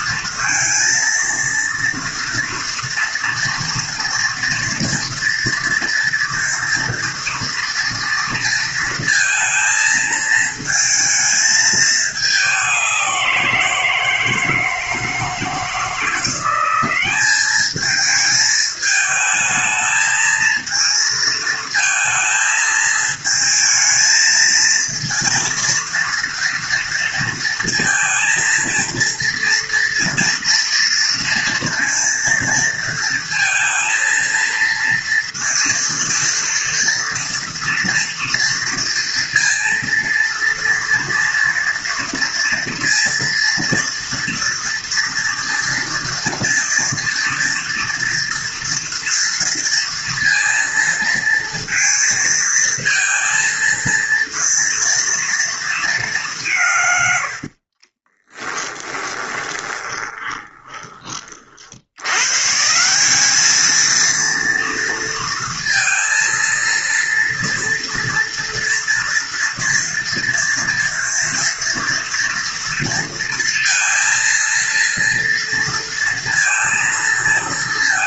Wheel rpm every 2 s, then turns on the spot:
230, 240, 230, 230, 230, 220, 200, 160, 180, 220, 220, 220, 230, 230, 230, 230, 230, 230, 230, 230, 230, 230, 230, 240, 240, 230, 230, 230, 160, 20, 20, 150, 230, 230, 230, 230, 230, 230, 230.
58-62